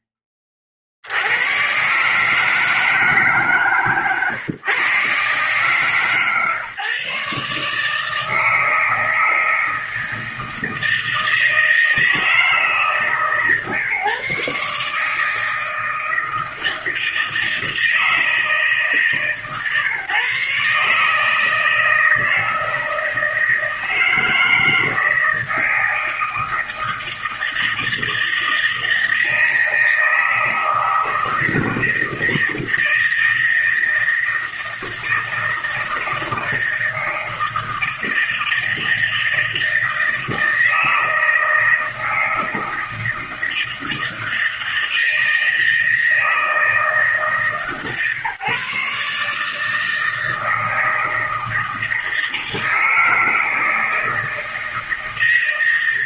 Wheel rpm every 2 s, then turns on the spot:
50, 150, 140, 140, 160, 160, 150, 150, 160, 150, 150, 160, 160, 160, 160, 160, 160, 160, 160, 160, 160, 160, 160, 150, 150, 160, 160, 160.
none